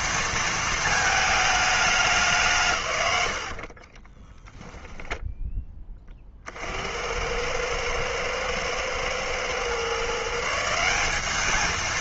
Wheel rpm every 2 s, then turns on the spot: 220, 120, 10, 70, 110, 170.
4-6